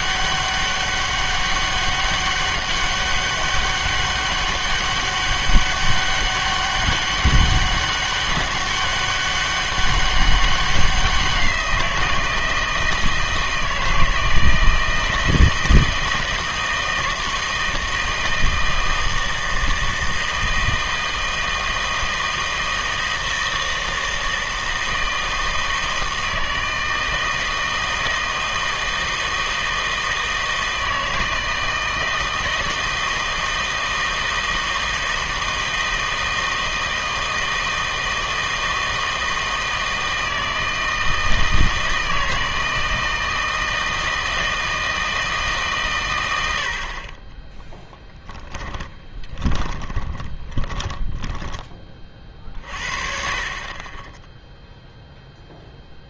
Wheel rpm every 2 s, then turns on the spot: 200, 200, 200, 200, 190, 190, 160, 160, 160, 160, 160, 160, 160, 160, 160, 160, 160, 160, 160, 160, 160, 160, 160, 70, 10, 20, 40, 0.
48-52